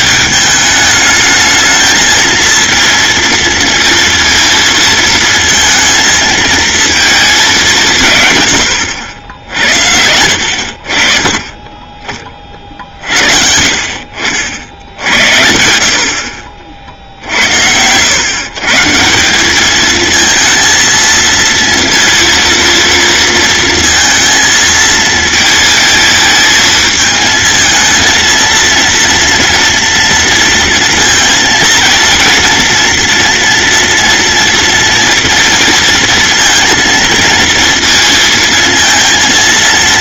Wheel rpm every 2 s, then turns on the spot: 210, 230, 230, 220, 90, 50, 50, 70, 50, 150, 230, 230, 220, 220, 230, 230, 230, 230, 230, 230.
8-10